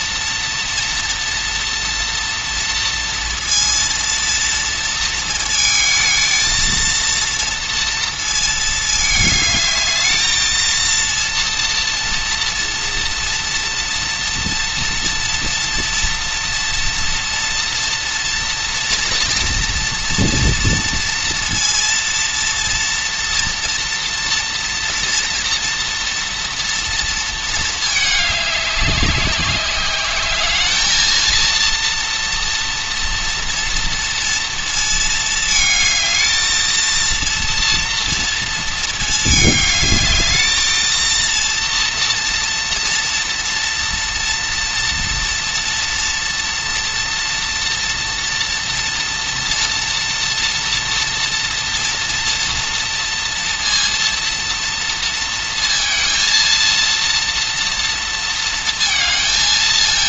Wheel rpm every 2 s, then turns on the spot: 230, 230, 230, 230, 220, 230, 230, 230, 230, 240, 230, 230, 230, 230, 200, 220, 230, 230, 230, 220, 230, 230, 230, 230, 230, 230, 230, 230, 230, 220.
none